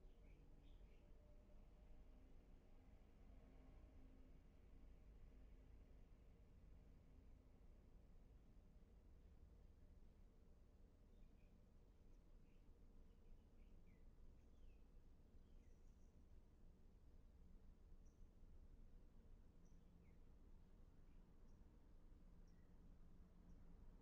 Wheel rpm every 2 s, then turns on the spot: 0, 0, 0, 0, 0, 0, 0, 0, 0, 0, 0, 0.
none